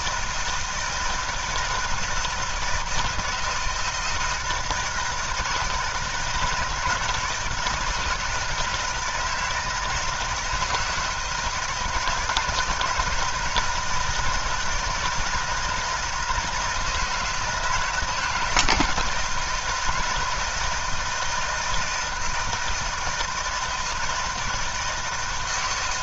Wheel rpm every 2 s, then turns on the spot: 160, 160, 160, 160, 160, 160, 160, 160, 160, 160, 170, 160, 160.
none